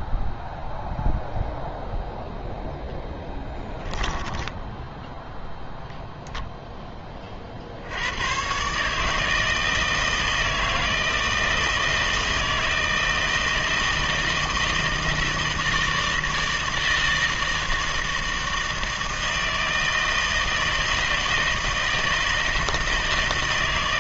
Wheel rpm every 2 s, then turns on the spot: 0, 10, 0, 100, 160, 160, 160, 160, 160, 160, 160, 160.
2-4